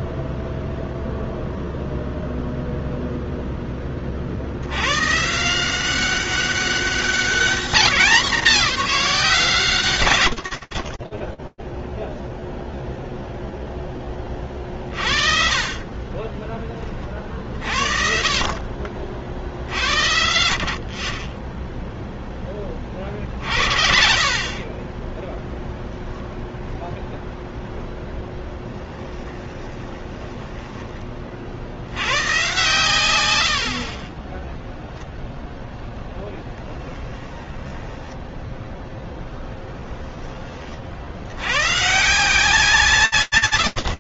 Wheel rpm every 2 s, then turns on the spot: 0, 0, 30, 180, 210, 120, 0, 40, 30, 50, 20, 40, 10, 20, 10, 10, 110, 20, 10, 10, 60, 80.
26-32 34-36 38-40